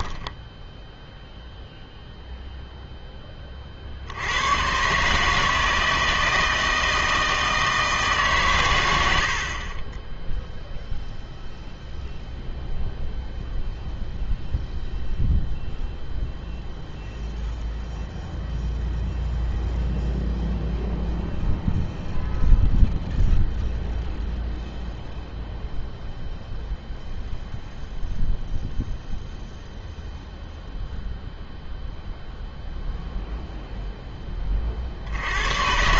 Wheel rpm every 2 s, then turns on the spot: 0, 0, 120, 160, 110, 0, 0, 0, 0, 0, 0, 0, 0, 0, 0, 0, 0, 40.
none